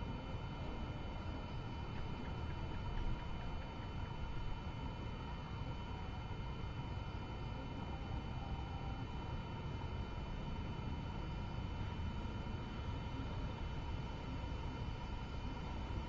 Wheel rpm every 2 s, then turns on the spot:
0, 0, 0, 0, 0, 0, 0, 0.
none